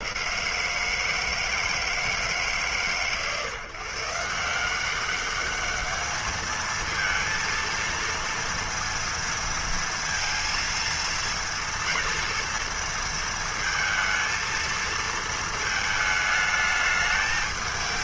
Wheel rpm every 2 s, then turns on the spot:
160, 130, 200, 230, 230, 230, 230, 230, 220.
none